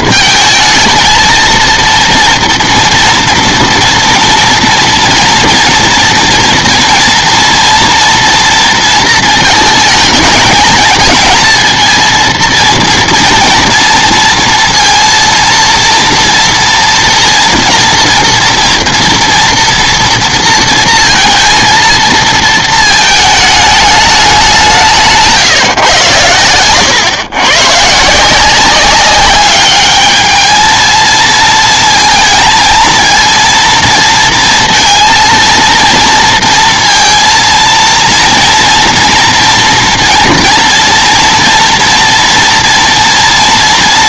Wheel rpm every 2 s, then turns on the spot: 230, 230, 240, 240, 230, 220, 230, 230, 230, 230, 230, 220, 180, 120, 190, 220, 230, 230, 230, 230, 230, 230.
none